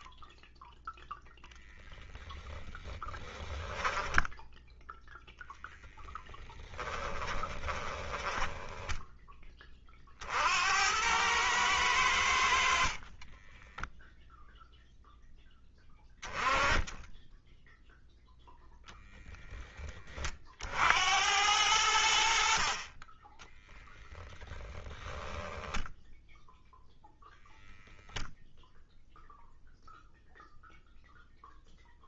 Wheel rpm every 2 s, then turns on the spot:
10, 10, 0, 10, 10, 90, 50, 0, 10, 0, 70, 40, 10, 0, 0, 0.
6-8 12-14 24-26